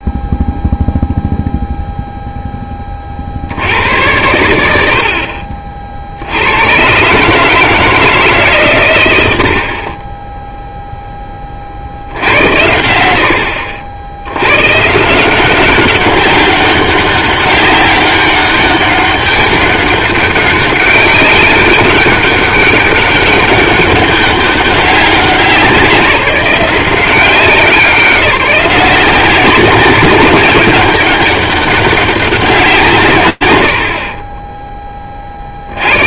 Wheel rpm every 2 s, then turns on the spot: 0, 20, 70, 120, 130, 0, 80, 140, 200, 200, 190, 200, 200, 180, 170, 190, 170, 10.
none